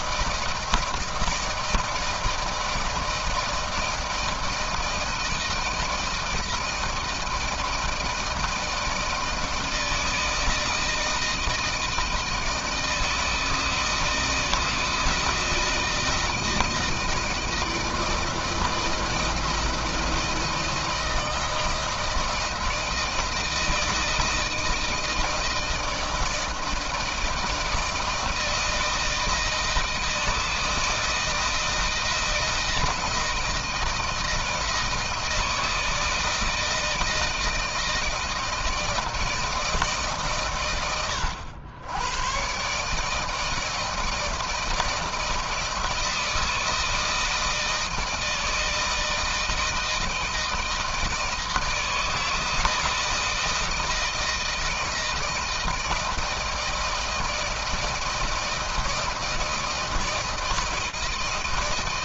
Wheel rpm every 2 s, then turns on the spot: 170, 160, 160, 160, 160, 160, 160, 160, 160, 160, 160, 160, 160, 160, 160, 160, 160, 160, 160, 160, 120, 120, 160, 160, 160, 160, 160, 160, 160, 160, 160.
none